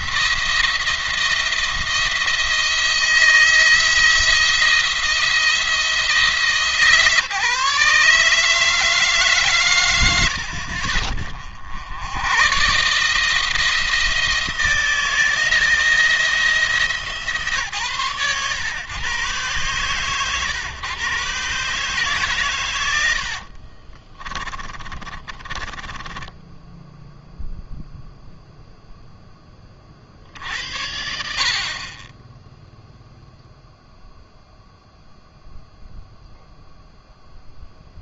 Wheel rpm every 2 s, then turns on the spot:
170, 170, 170, 150, 160, 60, 140, 170, 160, 120, 130, 120, 30, 10, 0, 60, 0, 0, 0.
22-28